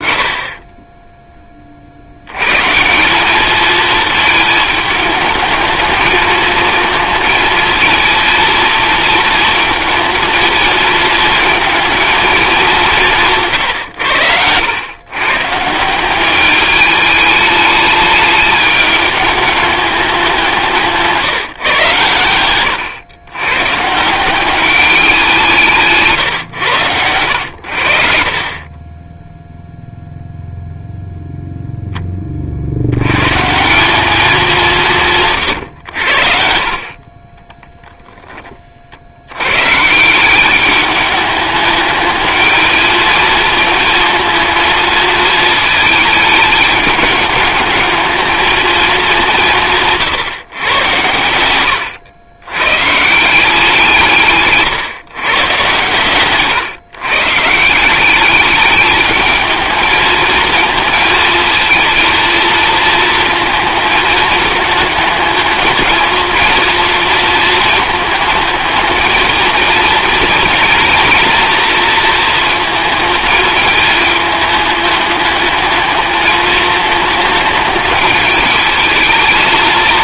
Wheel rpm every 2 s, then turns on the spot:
20, 160, 220, 220, 230, 230, 190, 100, 210, 210, 170, 110, 200, 110, 20, 0, 60, 180, 50, 50, 200, 220, 220, 210, 220, 110, 130, 130, 140, 210, 230, 230, 210, 230, 220, 230, 220, 210, 220, 220.
20-22 36-38